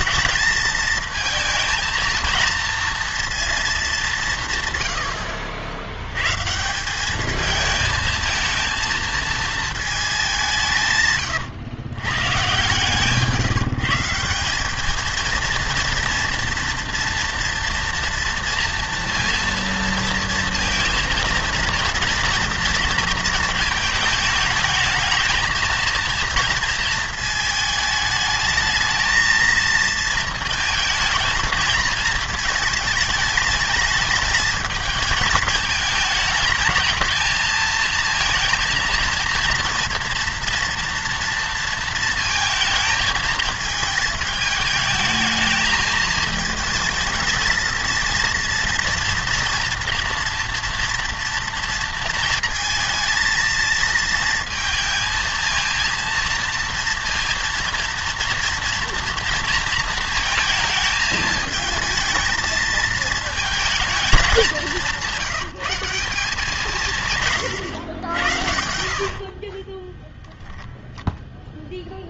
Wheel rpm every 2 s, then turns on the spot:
220, 230, 140, 150, 230, 170, 140, 200, 230, 230, 230, 230, 220, 230, 220, 230, 220, 220, 220, 230, 230, 220, 210, 220, 230, 230, 220, 220, 230, 230, 220, 220, 190, 160, 70, 0.
68-70